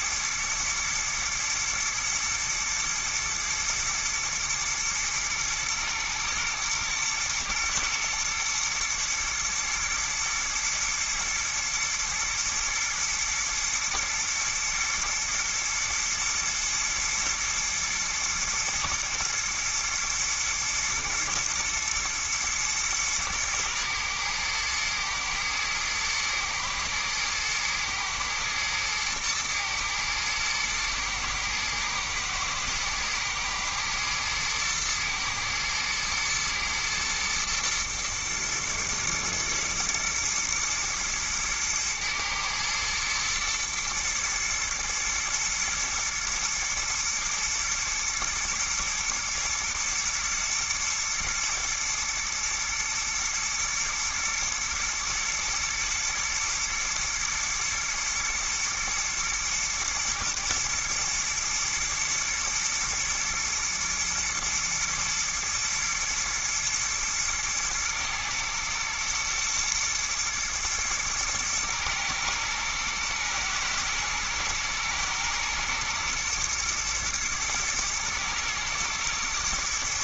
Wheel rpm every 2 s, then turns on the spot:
110, 110, 110, 120, 120, 110, 120, 120, 110, 110, 110, 110, 110, 120, 110, 120, 110, 110, 120, 120, 110, 120, 120, 110, 110, 110, 120, 110, 110, 110, 110, 110, 110, 110, 120, 110, 110, 110, 120, 110.
none